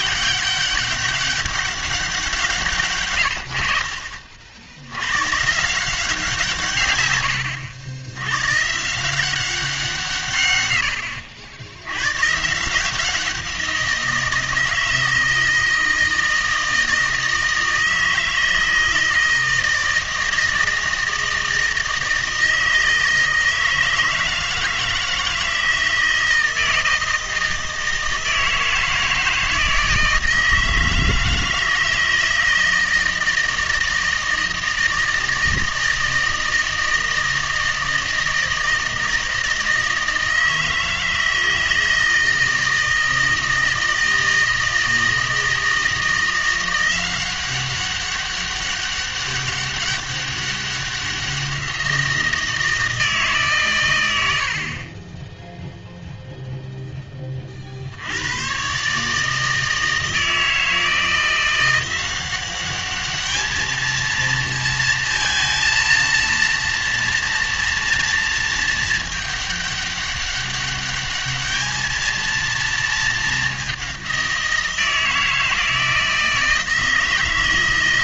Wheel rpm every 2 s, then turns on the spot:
200, 150, 80, 150, 130, 100, 150, 160, 160, 160, 160, 160, 160, 160, 160, 160, 160, 160, 160, 160, 160, 160, 160, 180, 200, 190, 160, 70, 0, 130, 160, 200, 230, 230, 220, 200, 230, 170, 160.
none